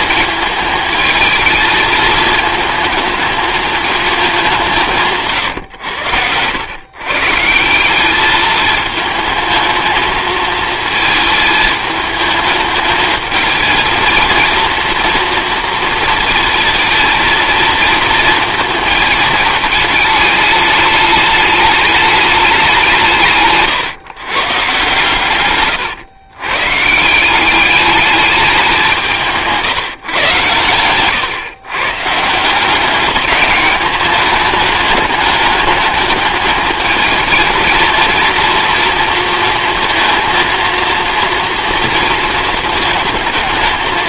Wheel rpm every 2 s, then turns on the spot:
220, 220, 180, 120, 220, 220, 220, 230, 230, 220, 210, 190, 140, 150, 190, 120, 180, 210, 220, 230, 230, 220.
none